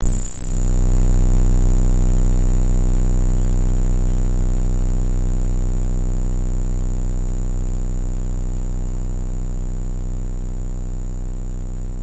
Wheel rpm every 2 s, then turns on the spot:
0, 0, 0, 0, 0, 0.
none